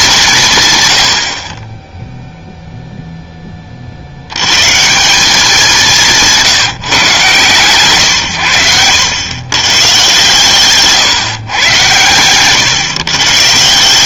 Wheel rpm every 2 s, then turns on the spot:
140, 0, 140, 160, 110, 140, 130.
8-10